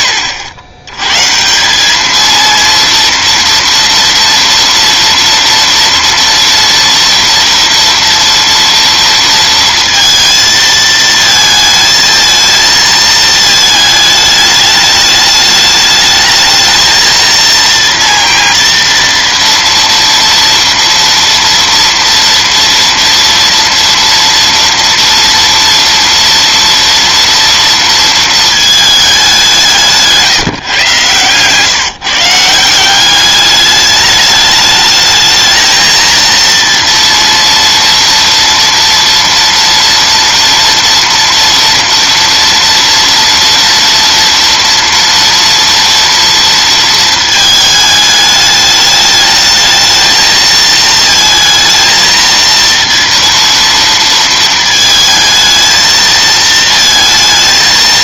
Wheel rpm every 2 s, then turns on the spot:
90, 230, 230, 230, 230, 220, 220, 210, 230, 230, 230, 230, 230, 230, 200, 130, 200, 220, 230, 230, 230, 230, 230, 220, 210, 220, 230, 220, 230.
none